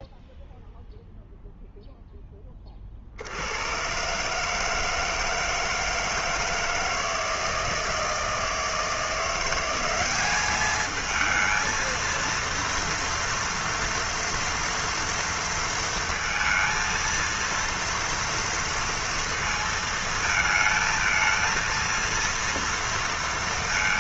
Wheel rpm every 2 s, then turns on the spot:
0, 10, 140, 160, 160, 200, 230, 230, 230, 230, 220, 230.
none